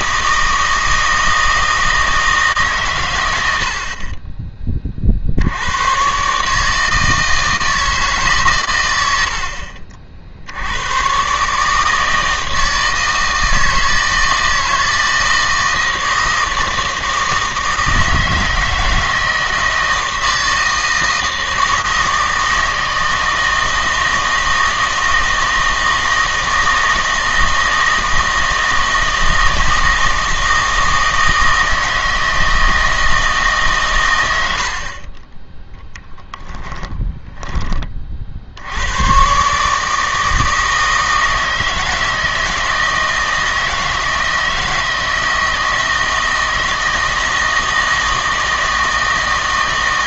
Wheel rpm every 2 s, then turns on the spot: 160, 140, 30, 150, 120, 100, 160, 160, 160, 160, 160, 160, 160, 160, 160, 160, 160, 60, 10, 90, 160, 160, 160, 160, 160.
36-38